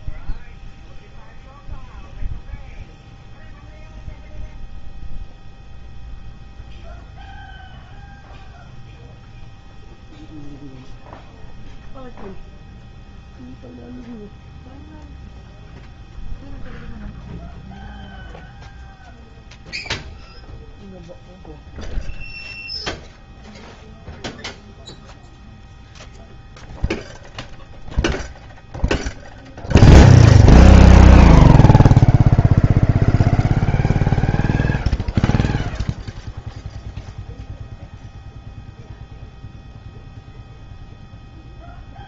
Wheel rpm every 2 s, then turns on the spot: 0, 0, 0, 0, 0, 0, 0, 0, 0, 0, 0, 0, 0, 0, 0, 0, 0, 0, 0, 0, 0.
none